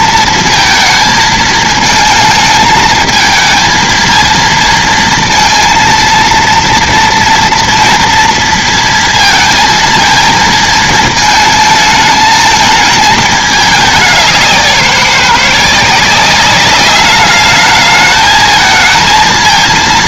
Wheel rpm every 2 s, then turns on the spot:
220, 220, 230, 230, 230, 220, 220, 190, 200, 220.
none